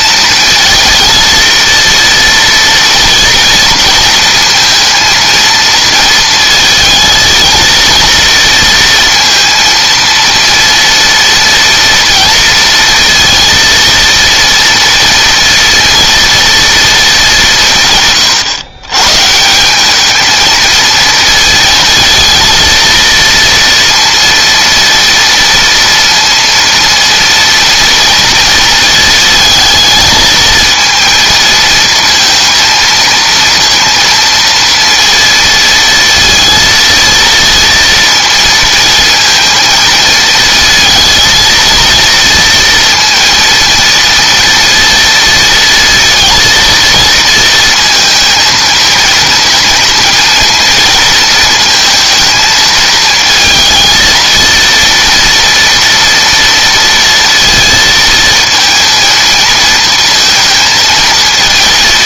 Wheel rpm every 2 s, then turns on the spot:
230, 230, 230, 230, 230, 230, 230, 230, 220, 130, 220, 230, 230, 230, 230, 220, 230, 230, 230, 230, 230, 230, 230, 230, 230, 230, 220, 230, 230, 230, 220.
none